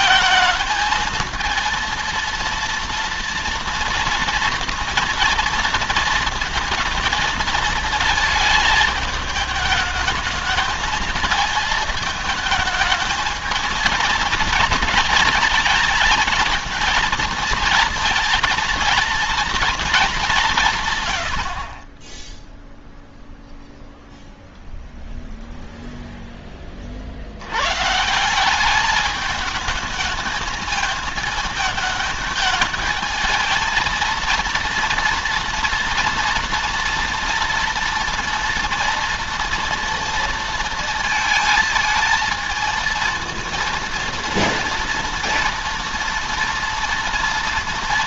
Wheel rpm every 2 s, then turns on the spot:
220, 230, 230, 230, 220, 220, 220, 220, 230, 230, 130, 0, 0, 40, 210, 220, 220, 230, 230, 230, 230, 230, 230, 230.
none